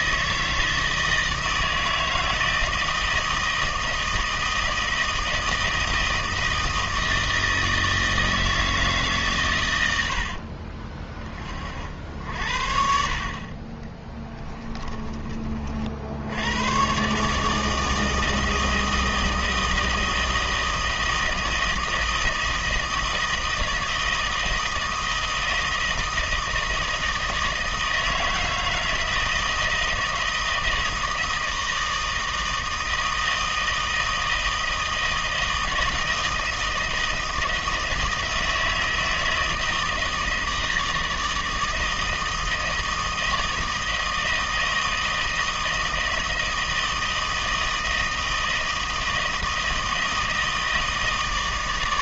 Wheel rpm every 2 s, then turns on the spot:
160, 160, 160, 160, 160, 40, 60, 20, 110, 160, 160, 160, 160, 160, 160, 160, 160, 160, 160, 160, 160, 160, 160, 160, 160, 160.
10-12 14-16